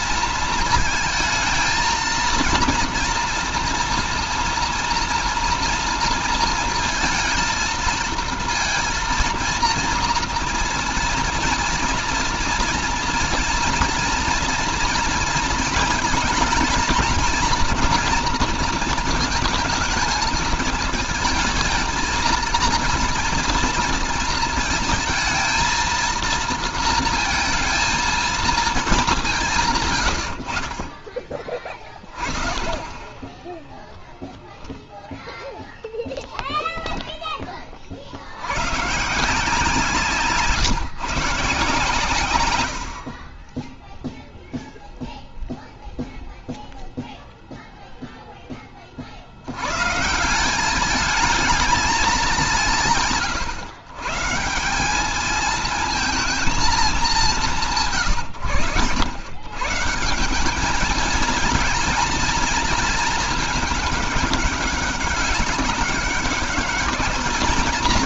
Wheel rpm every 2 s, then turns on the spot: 230, 230, 230, 230, 230, 230, 230, 230, 220, 230, 220, 220, 230, 230, 220, 50, 30, 0, 10, 110, 160, 100, 0, 0, 20, 190, 180, 180, 220, 100, 210, 230, 200, 210.
none